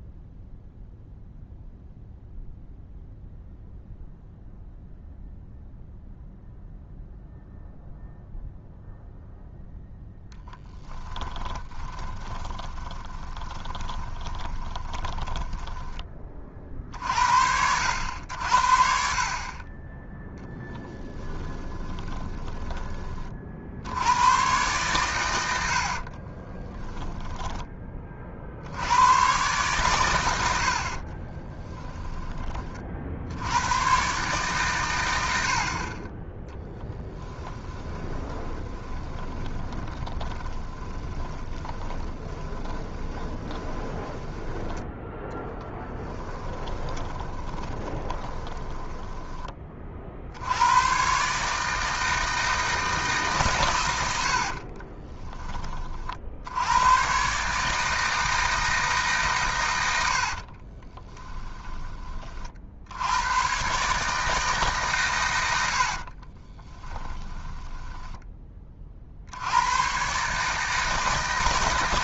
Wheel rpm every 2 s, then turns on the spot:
0, 0, 0, 0, 0, 20, 20, 20, 50, 60, 10, 20, 120, 20, 90, 50, 40, 120, 10, 20, 20, 20, 10, 20, 10, 110, 160, 40, 110, 150, 30, 70, 140, 20, 30, 160.
10-16 20-22 26-28 38-44 46-50 54-56 60-62 66-68